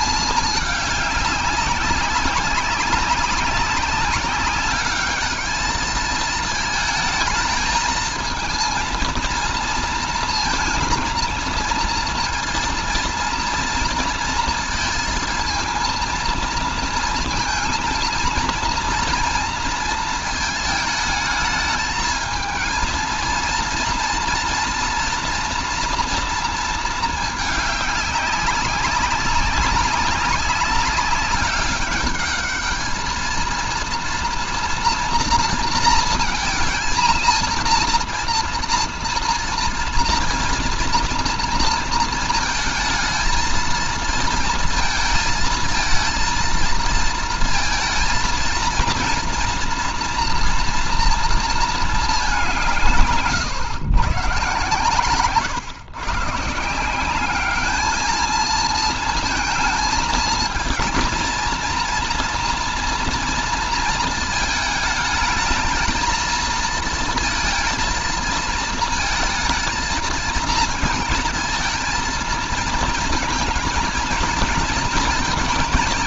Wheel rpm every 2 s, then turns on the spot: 210, 200, 200, 220, 220, 230, 230, 230, 230, 230, 220, 230, 230, 230, 200, 190, 210, 240, 230, 230, 230, 220, 220, 230, 230, 230, 170, 120, 160, 220, 230, 230, 220, 230, 230, 230, 230, 230.
none